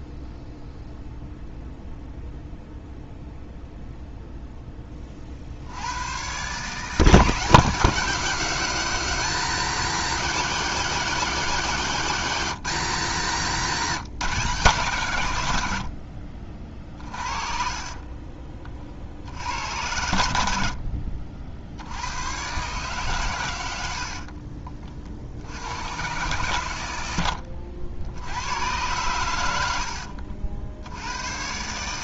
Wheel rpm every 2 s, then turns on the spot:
0, 0, 20, 160, 180, 180, 150, 150, 40, 40, 60, 130, 40, 110, 90, 80.
20-22